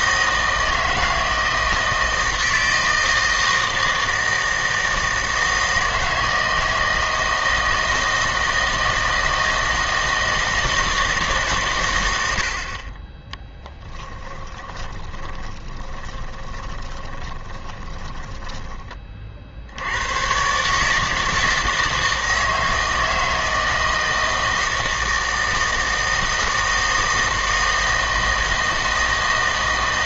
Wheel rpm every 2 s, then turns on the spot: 160, 160, 160, 160, 160, 160, 60, 20, 20, 20, 140, 160, 160, 160, 160.
14-18